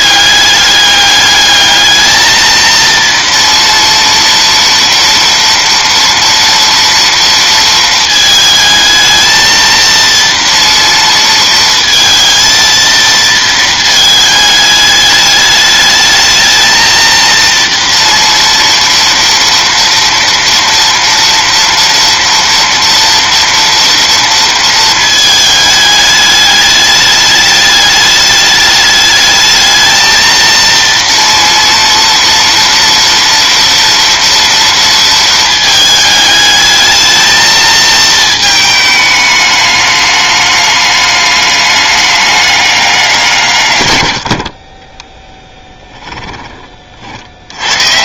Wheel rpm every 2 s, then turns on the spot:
200, 230, 230, 240, 220, 230, 230, 210, 220, 230, 230, 230, 230, 210, 210, 230, 230, 230, 220, 220, 210, 200, 30, 30.
none